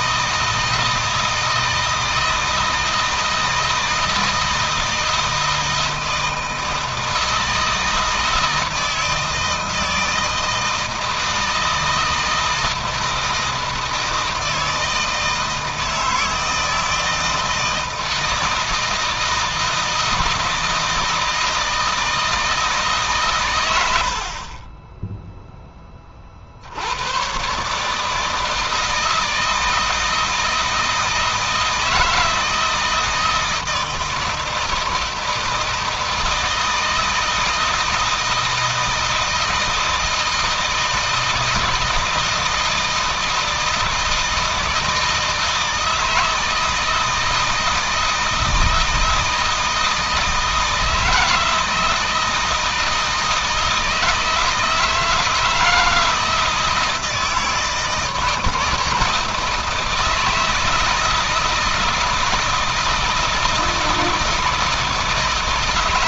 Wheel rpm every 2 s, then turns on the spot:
160, 160, 160, 160, 160, 160, 160, 160, 160, 160, 160, 160, 30, 60, 160, 160, 160, 160, 160, 160, 160, 160, 160, 160, 160, 160, 160, 160, 160, 150, 160, 160, 160.
none